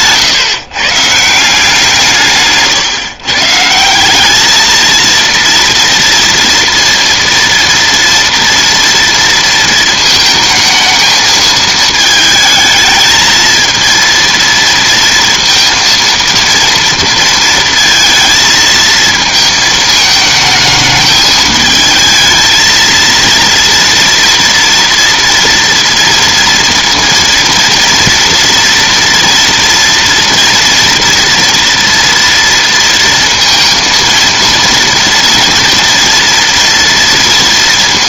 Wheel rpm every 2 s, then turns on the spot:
140, 160, 220, 230, 230, 220, 220, 230, 230, 220, 220, 230, 230, 230, 230, 230, 230, 230, 230.
none